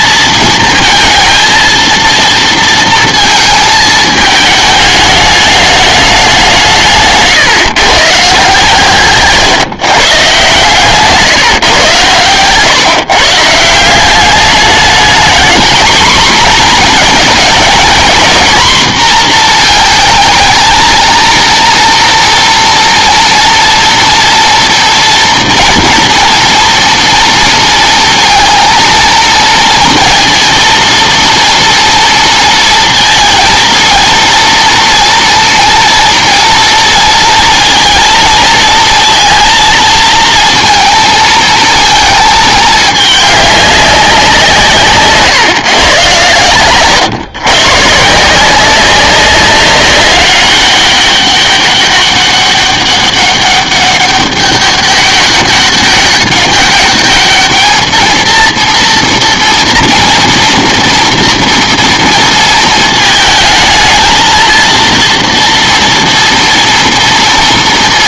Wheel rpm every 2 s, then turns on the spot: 230, 230, 210, 170, 150, 140, 130, 210, 240, 230, 230, 230, 230, 230, 230, 230, 230, 230, 230, 230, 230, 220, 170, 110, 180, 200, 200, 200, 200, 230, 230, 220, 230, 230.
46-48